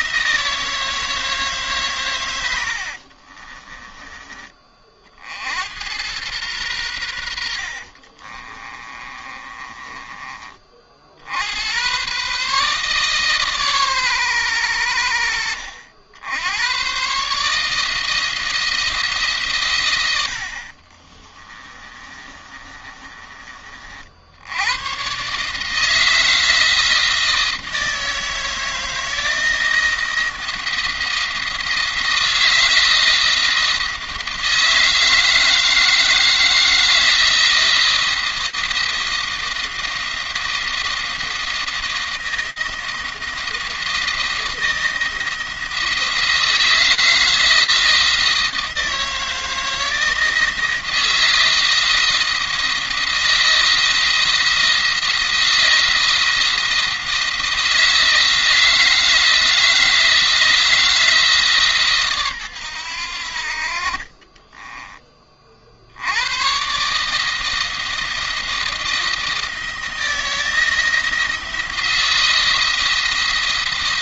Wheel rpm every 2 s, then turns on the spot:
160, 60, 40, 100, 30, 50, 140, 90, 120, 160, 60, 30, 110, 160, 160, 170, 170, 160, 160, 170, 170, 170, 170, 170, 160, 160, 170, 170, 170, 160, 160, 100, 20, 140, 160, 170, 170.
2-4 8-10 20-24